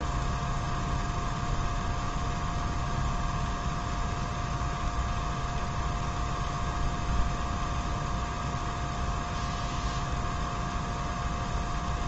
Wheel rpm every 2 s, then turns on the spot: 0, 0, 0, 0, 0, 0.
none